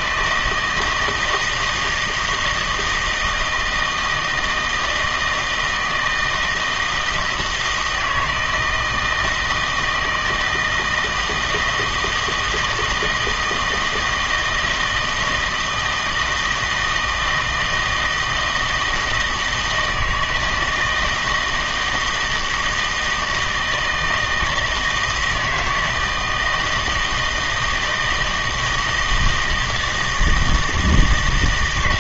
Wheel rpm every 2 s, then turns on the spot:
160, 160, 160, 160, 160, 160, 160, 160, 160, 160, 160, 160, 170, 160, 160, 160.
none